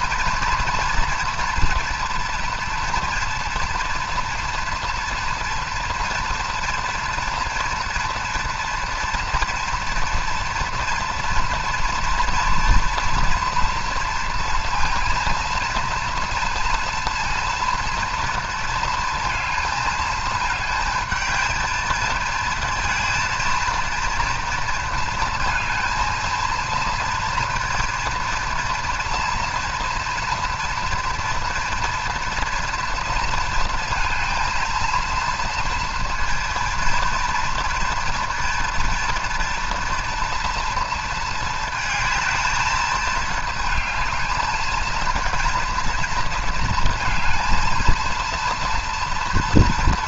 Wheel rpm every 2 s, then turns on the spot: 230, 230, 240, 240, 230, 230, 230, 230, 230, 230, 220, 230, 230, 230, 230, 230, 230, 230, 230, 230, 230, 220, 220, 230, 230.
none